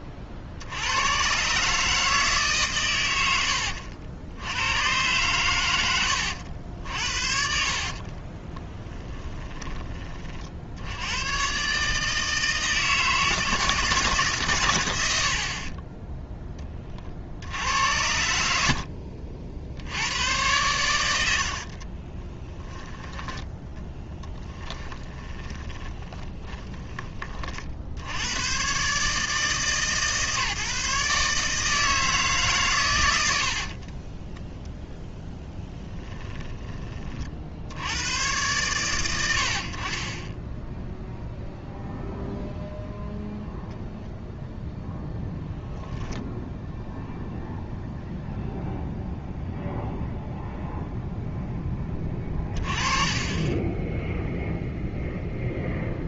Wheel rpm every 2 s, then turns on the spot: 50, 130, 100, 70, 10, 70, 160, 120, 20, 70, 110, 10, 20, 20, 120, 150, 130, 20, 20, 110, 0, 0, 0, 0, 0, 0, 30, 0.
6-10 24-28 34-36 52-54